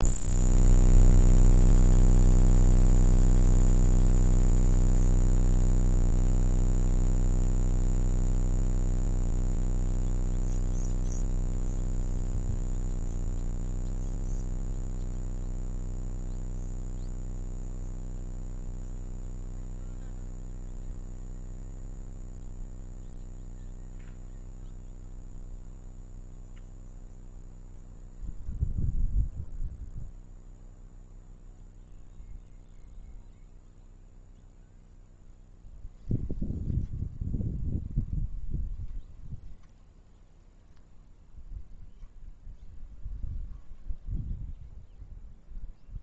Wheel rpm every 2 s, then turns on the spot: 0, 0, 0, 0, 0, 0, 0, 0, 0, 0, 0, 0, 0, 0, 0, 0, 0, 0, 0, 0, 0, 0, 0.
none